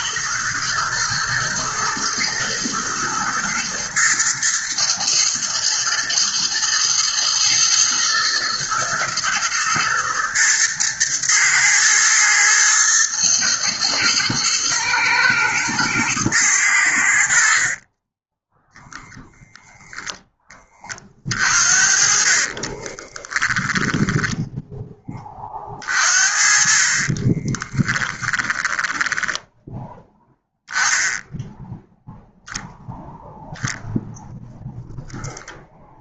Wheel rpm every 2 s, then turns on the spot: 120, 110, 110, 120, 120, 110, 110, 120, 90, 0, 30, 30, 10, 40, 20, 0, 0, 0.
22-24 28-30